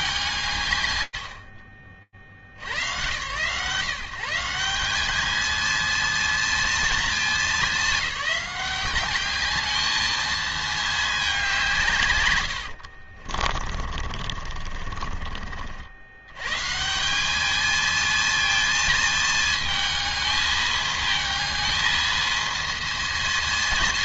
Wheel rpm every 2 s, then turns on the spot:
60, 180, 230, 200, 220, 90, 40, 160, 220, 220, 220, 220.
10-14